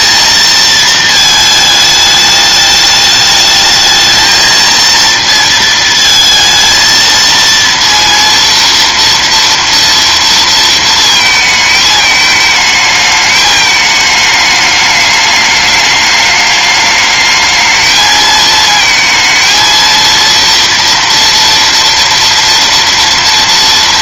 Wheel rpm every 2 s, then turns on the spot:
230, 210, 230, 230, 230, 230, 220, 210, 210, 220, 230, 230.
none